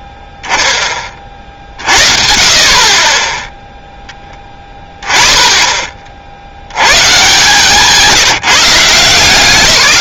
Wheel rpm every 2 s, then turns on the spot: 0, 60, 10, 80, 180.
none